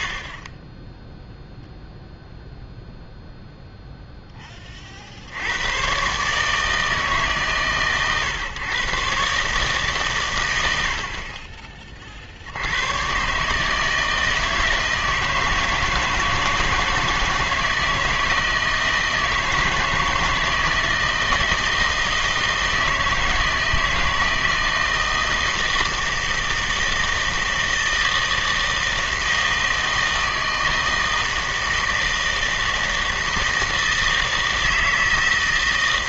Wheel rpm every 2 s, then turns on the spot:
10, 0, 40, 160, 130, 90, 80, 160, 160, 160, 160, 160, 160, 160, 160, 160, 160, 160.
none